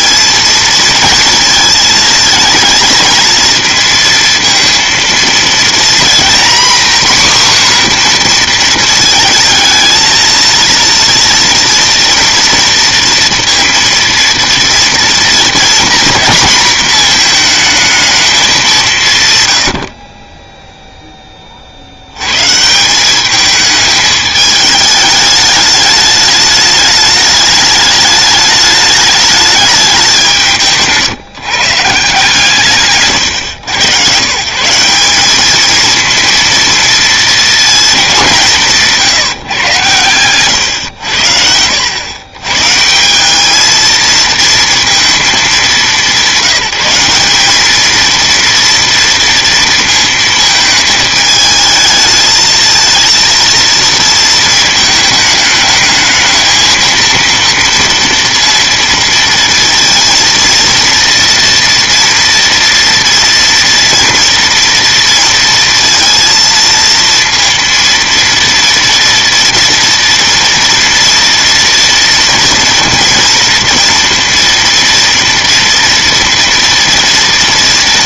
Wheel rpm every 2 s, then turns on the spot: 230, 230, 230, 250, 240, 230, 230, 230, 230, 190, 0, 140, 210, 210, 210, 180, 150, 150, 230, 170, 120, 130, 230, 190, 230, 220, 220, 220, 220, 230, 230, 230, 230, 230, 230, 230, 230, 230, 230.
none